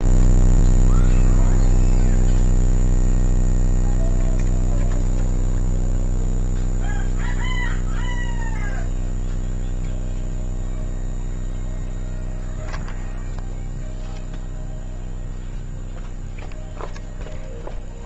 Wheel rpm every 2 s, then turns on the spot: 0, 0, 0, 0, 0, 0, 0, 0, 0.
none